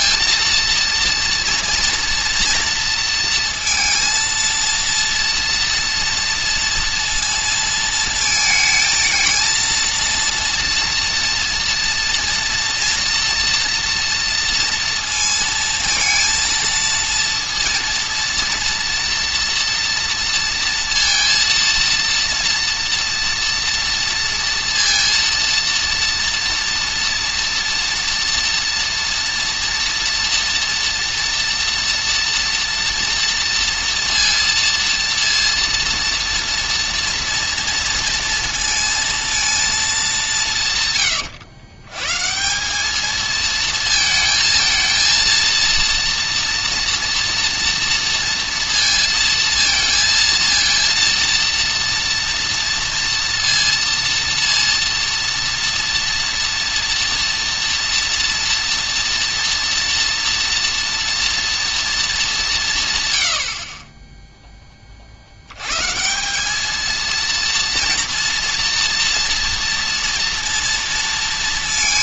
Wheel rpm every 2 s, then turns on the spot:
230, 230, 230, 230, 220, 230, 230, 230, 230, 230, 230, 230, 230, 230, 230, 230, 230, 230, 230, 230, 150, 190, 230, 230, 230, 230, 230, 230, 240, 230, 230, 190, 10, 220, 230, 230.
none